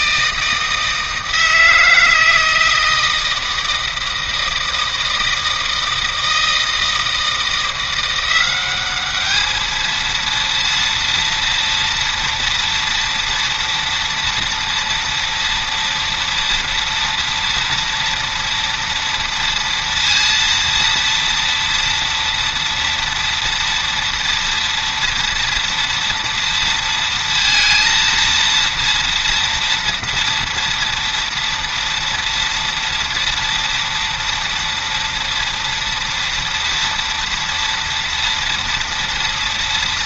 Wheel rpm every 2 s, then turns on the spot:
160, 160, 160, 160, 190, 230, 230, 230, 230, 230, 230, 230, 230, 230, 230, 230, 230, 240, 230, 230.
none